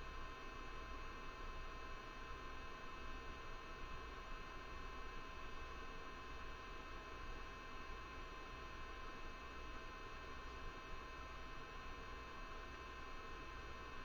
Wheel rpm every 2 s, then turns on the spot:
0, 0, 0, 0, 0, 0, 0.
none